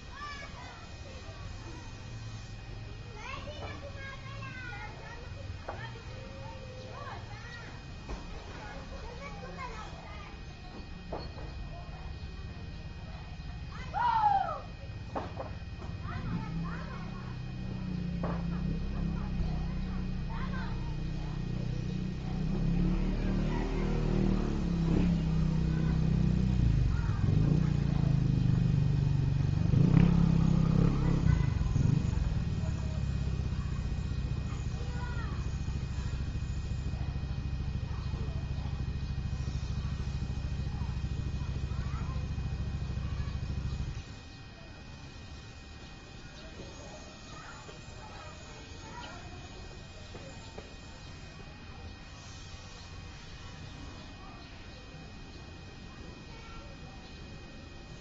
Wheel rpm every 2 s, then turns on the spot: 0, 0, 0, 0, 0, 0, 0, 0, 0, 0, 0, 0, 0, 0, 0, 0, 0, 0, 0, 0, 0, 0, 0, 0, 0, 0, 0, 0, 0.
none